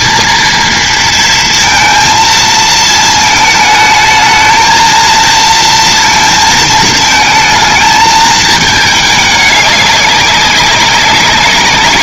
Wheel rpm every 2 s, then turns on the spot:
230, 220, 220, 220, 220, 200.
none